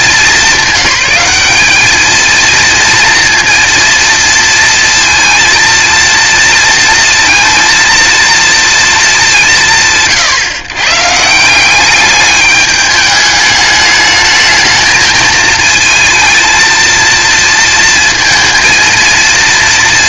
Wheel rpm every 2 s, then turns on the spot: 200, 230, 230, 230, 230, 130, 210, 220, 220, 230.
none